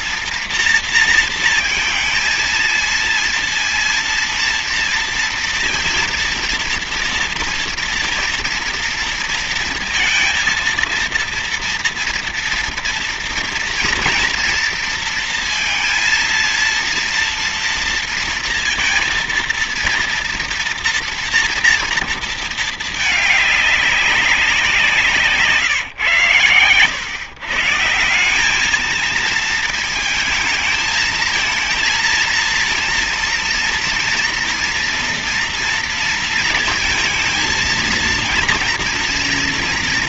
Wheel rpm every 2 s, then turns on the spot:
230, 230, 230, 230, 230, 230, 230, 230, 230, 230, 230, 220, 170, 120, 210, 220, 230, 240, 220, 230.
none